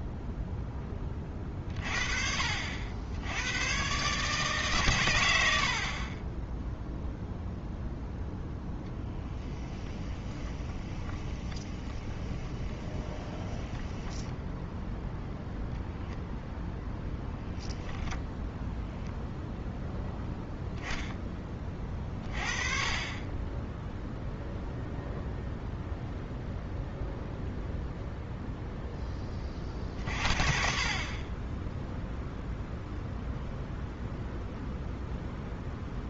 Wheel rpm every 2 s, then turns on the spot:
10, 60, 150, 0, 10, 20, 20, 0, 0, 0, 0, 30, 0, 0, 0, 40, 0, 0.
10-14